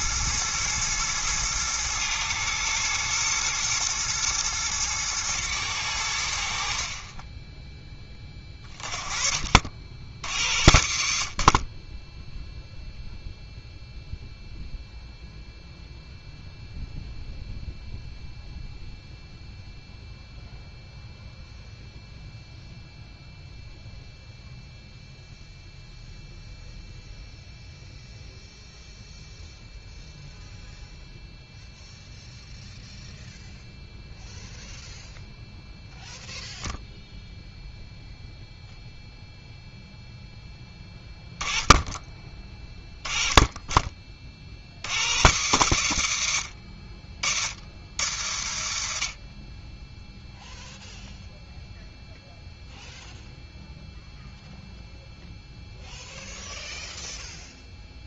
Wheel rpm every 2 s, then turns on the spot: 110, 120, 110, 50, 20, 70, 0, 0, 0, 0, 0, 0, 0, 0, 0, 0, 0, 0, 0, 0, 10, 10, 80, 50, 80, 0, 0, 0, 0.
none